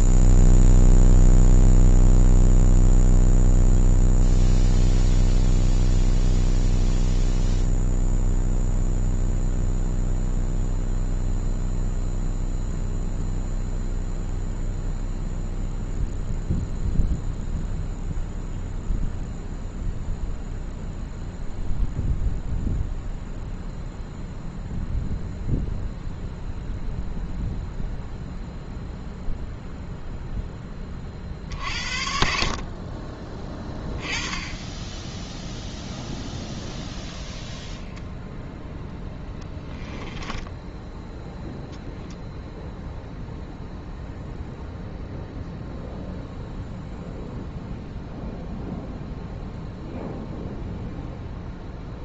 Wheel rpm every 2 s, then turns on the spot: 0, 0, 0, 0, 0, 0, 0, 0, 0, 0, 0, 0, 0, 0, 0, 10, 50, 20, 10, 0, 10, 0, 0, 0, 0, 0.
40-42